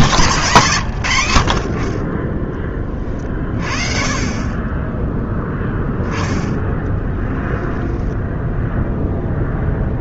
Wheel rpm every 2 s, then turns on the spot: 20, 20, 10, 0, 0.
none